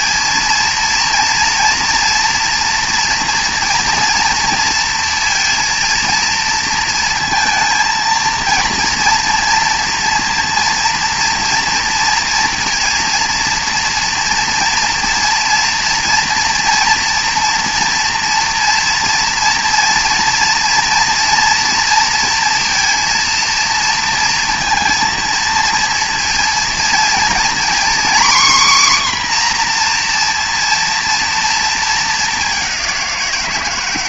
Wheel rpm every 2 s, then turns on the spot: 230, 240, 230, 230, 230, 230, 230, 240, 240, 230, 230, 230, 230, 230, 260, 230, 200.
none